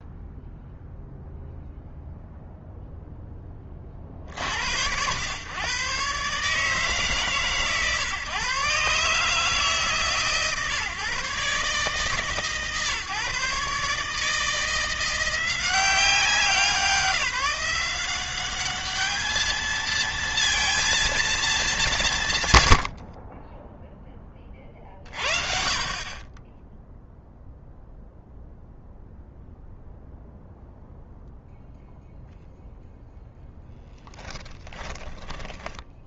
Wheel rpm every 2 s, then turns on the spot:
0, 0, 90, 150, 150, 140, 140, 170, 170, 210, 220, 50, 40, 0, 0, 0, 0, 10.
22-24